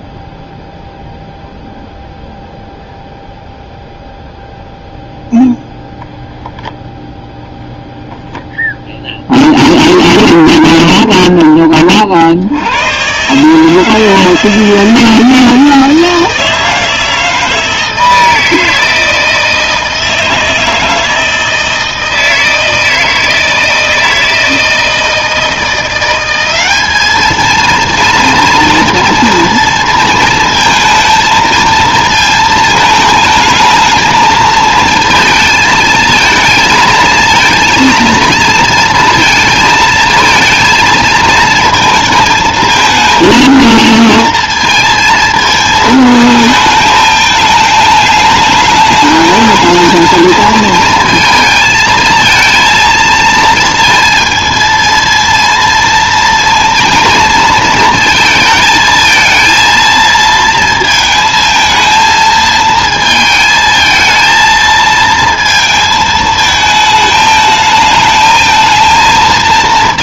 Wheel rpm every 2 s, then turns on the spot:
0, 0, 0, 0, 0, 10, 90, 160, 160, 160, 160, 160, 160, 200, 230, 220, 220, 230, 220, 230, 220, 220, 230, 220, 210, 230, 230, 230, 230, 220, 220, 220, 230, 220, 220.
10-12